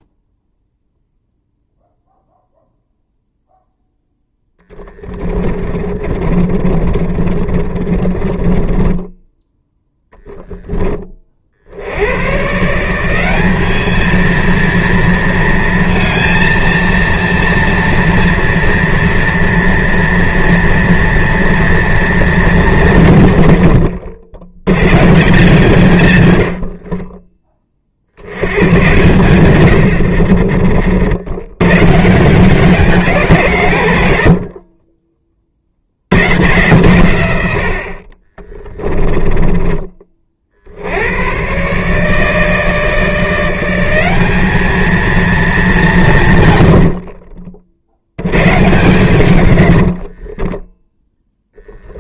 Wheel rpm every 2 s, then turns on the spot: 0, 0, 10, 30, 20, 20, 150, 230, 230, 230, 230, 170, 130, 70, 110, 50, 190, 40, 130, 20, 60, 160, 220, 100, 130, 20.
4-12 22-24 26-28 34-36 38-40 50-52